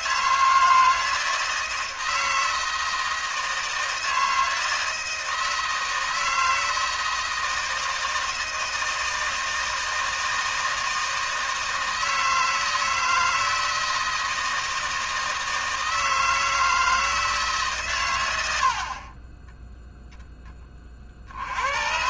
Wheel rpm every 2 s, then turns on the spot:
160, 160, 160, 160, 160, 160, 160, 160, 160, 50, 30.
none